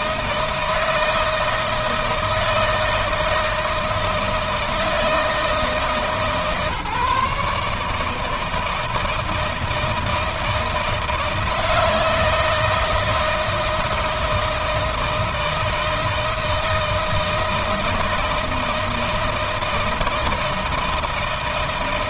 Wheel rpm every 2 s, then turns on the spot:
160, 160, 160, 150, 160, 160, 160, 160, 160, 160, 160.
none